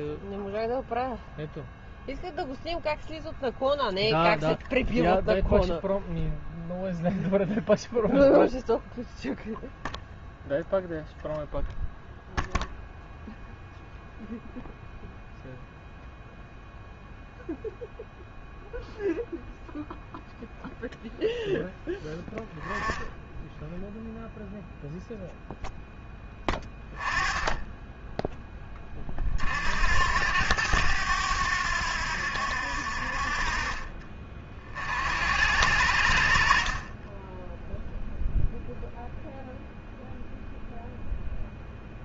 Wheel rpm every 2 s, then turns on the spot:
0, 0, 0, 0, 0, 0, 0, 0, 0, 0, 0, 10, 0, 20, 10, 90, 70, 50, 40, 0, 0.
none